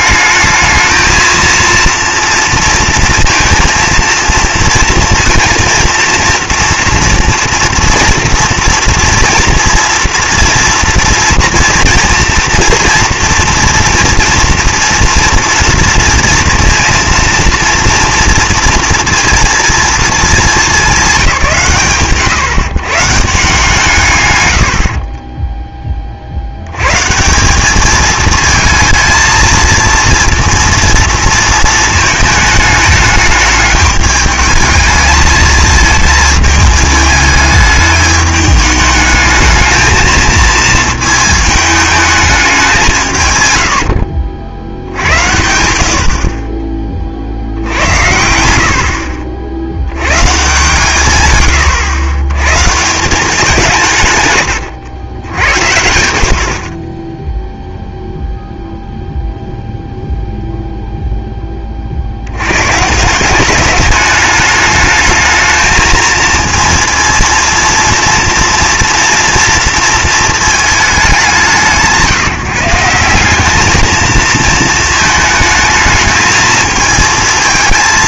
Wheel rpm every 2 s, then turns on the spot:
220, 230, 230, 230, 240, 230, 230, 240, 230, 230, 210, 130, 90, 90, 220, 230, 210, 220, 220, 210, 220, 190, 70, 30, 70, 140, 140, 110, 50, 0, 0, 130, 210, 230, 230, 220, 160, 220, 220.
none